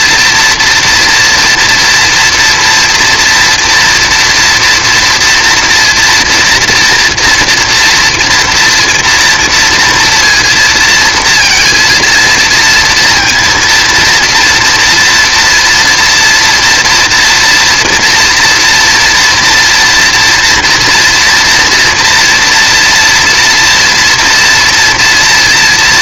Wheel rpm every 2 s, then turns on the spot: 240, 230, 230, 230, 240, 230, 230, 230, 230, 230, 230, 240, 230.
none